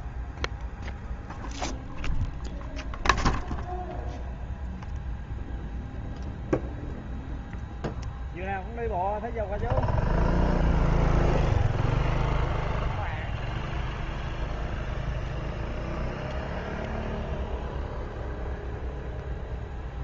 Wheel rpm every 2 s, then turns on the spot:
0, 0, 0, 0, 0, 0, 0, 0, 0, 0.
none